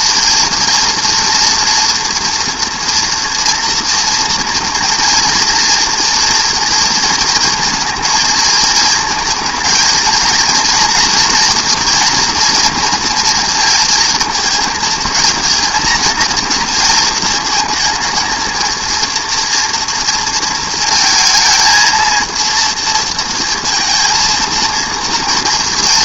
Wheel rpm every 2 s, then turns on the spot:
230, 230, 240, 230, 230, 230, 230, 220, 230, 230, 230, 230, 230.
none